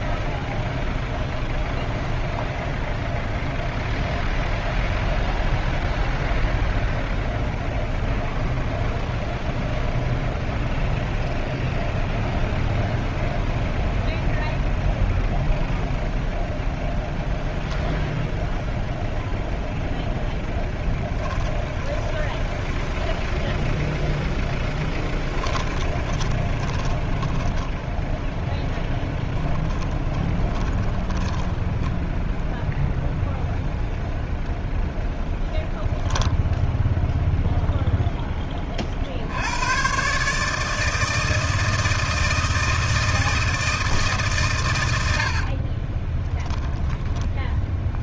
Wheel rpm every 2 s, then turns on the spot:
0, 0, 0, 0, 0, 0, 0, 0, 0, 0, 10, 20, 10, 30, 20, 20, 0, 0, 0, 30, 160, 160, 100, 10.
20-32 46-48